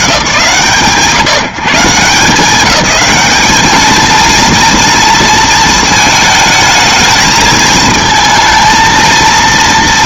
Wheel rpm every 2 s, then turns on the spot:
90, 180, 230, 220, 230.
none